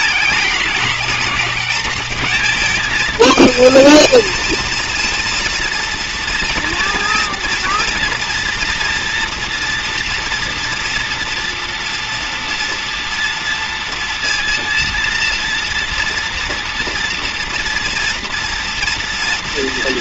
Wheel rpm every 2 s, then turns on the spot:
220, 220, 230, 230, 230, 230, 230, 230, 230, 230.
none